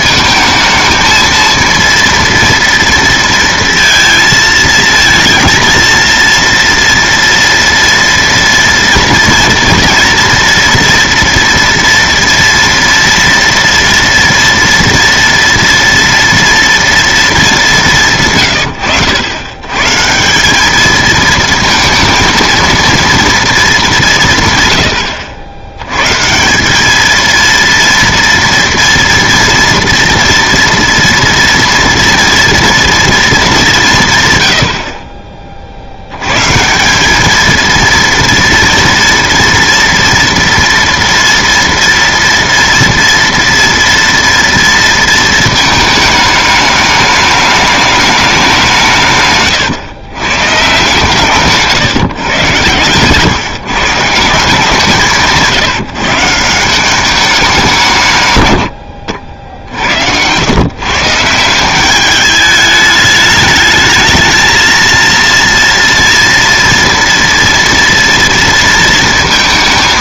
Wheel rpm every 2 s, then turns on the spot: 220, 230, 220, 230, 230, 230, 230, 240, 230, 120, 200, 230, 130, 190, 240, 230, 230, 80, 150, 230, 230, 230, 230, 210, 180, 130, 130, 170, 170, 100, 130, 210, 230, 230, 230.
52-54